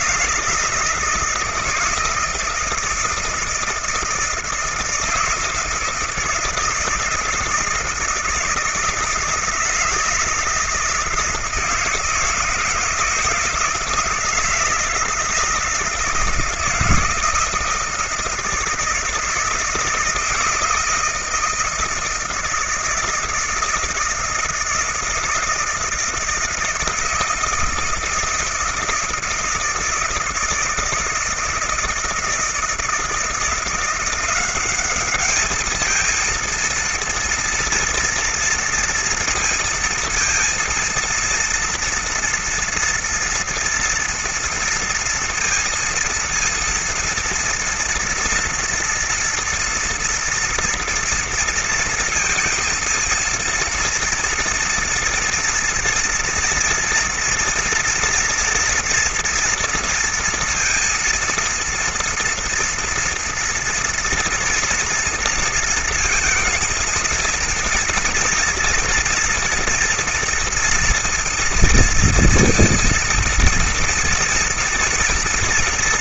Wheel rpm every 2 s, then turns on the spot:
160, 160, 160, 170, 160, 160, 160, 160, 160, 160, 160, 160, 160, 160, 160, 160, 160, 190, 230, 230, 230, 230, 230, 230, 230, 230, 230, 230, 230, 230, 230, 230, 230, 230, 230, 230, 230, 230.
none